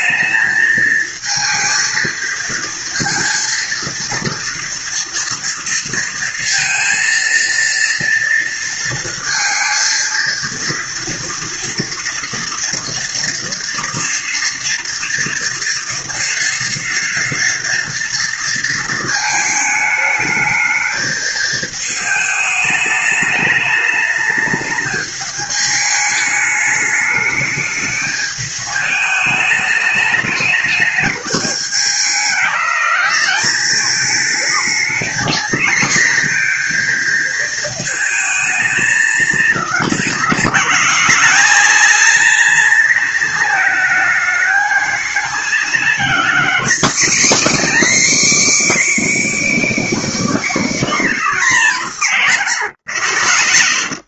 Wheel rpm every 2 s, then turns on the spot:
220, 230, 230, 230, 230, 230, 240, 240, 230, 230, 220, 210, 210, 210, 210, 210, 200, 220, 240, 220, 200, 230, 220, 250, 320, 300, 120.
none